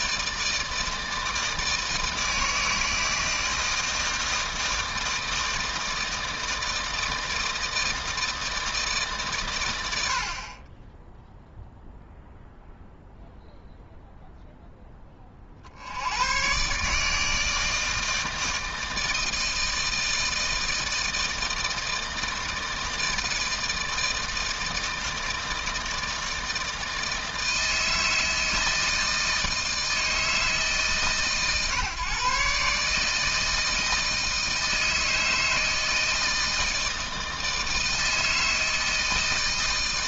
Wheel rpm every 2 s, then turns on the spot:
160, 160, 160, 160, 150, 10, 0, 10, 140, 160, 160, 160, 160, 160, 160, 140, 150, 160, 160, 160.
none